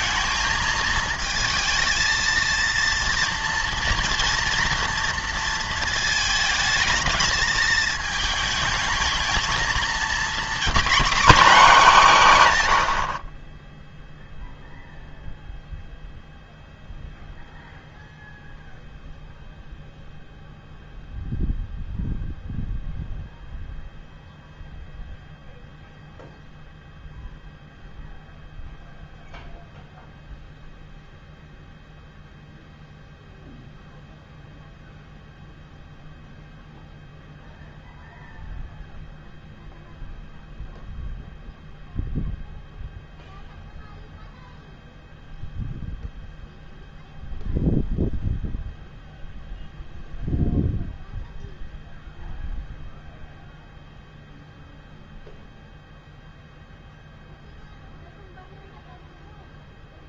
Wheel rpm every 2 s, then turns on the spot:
220, 230, 230, 220, 220, 260, 130, 0, 0, 0, 0, 0, 0, 0, 0, 0, 0, 0, 0, 0, 0, 0, 0, 0, 0, 0, 0, 0, 0, 0.
none